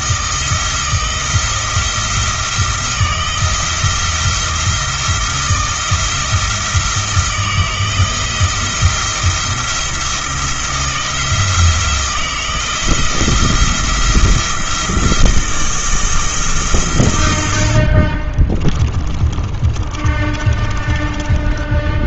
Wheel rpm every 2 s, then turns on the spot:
160, 170, 160, 160, 170, 170, 170, 170, 140, 30, 20.
18-22